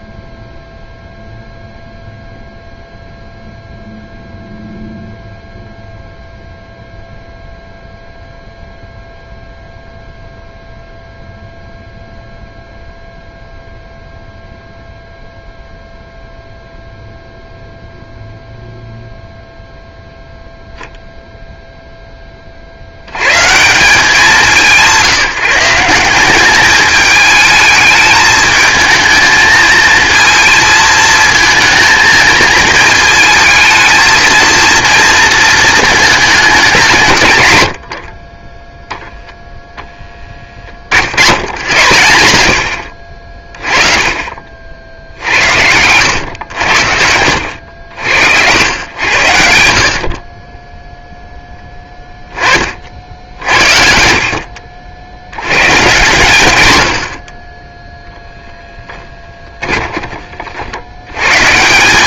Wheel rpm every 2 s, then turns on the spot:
0, 0, 0, 0, 0, 0, 0, 0, 0, 0, 0, 70, 180, 210, 220, 230, 220, 230, 160, 0, 60, 60, 60, 70, 90, 10, 50, 60, 90, 10, 80.
58-60